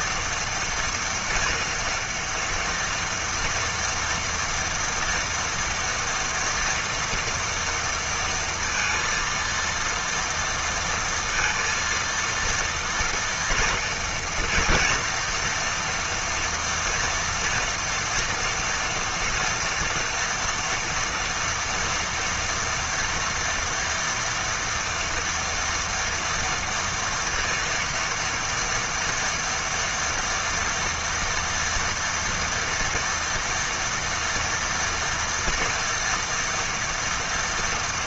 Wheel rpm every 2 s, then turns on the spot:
240, 230, 230, 230, 230, 230, 230, 230, 230, 240, 240, 230, 240, 230, 230, 230, 230, 240, 230.
none